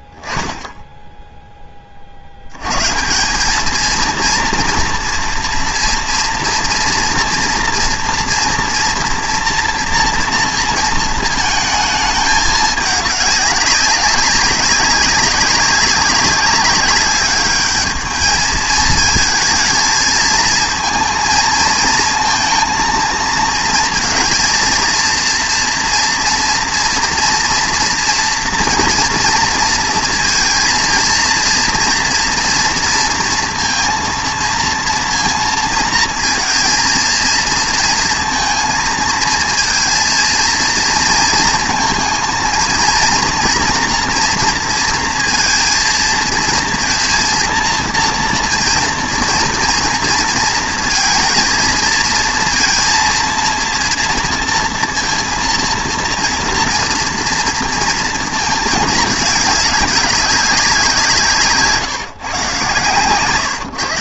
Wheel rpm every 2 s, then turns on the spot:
0, 130, 230, 230, 230, 230, 210, 200, 190, 220, 230, 230, 230, 230, 230, 220, 230, 230, 230, 230, 230, 230, 230, 230, 230, 230, 230, 230, 230, 220, 180, 130.
none